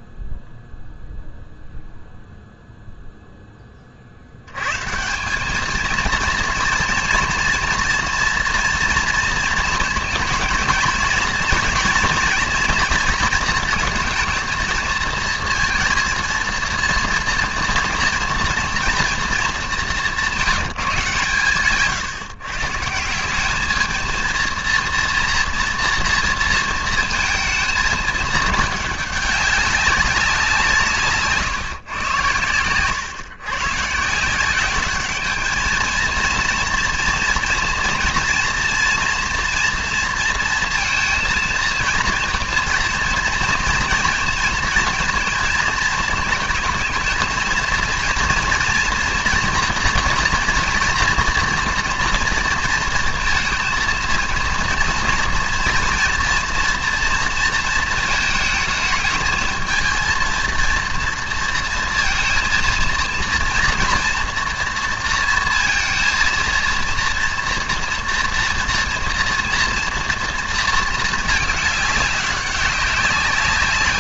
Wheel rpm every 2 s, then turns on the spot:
0, 0, 110, 230, 230, 230, 240, 230, 230, 230, 190, 150, 230, 230, 210, 170, 110, 190, 230, 230, 230, 230, 230, 220, 230, 240, 230, 230, 230, 220, 230, 230, 230, 230, 230, 230, 190.
none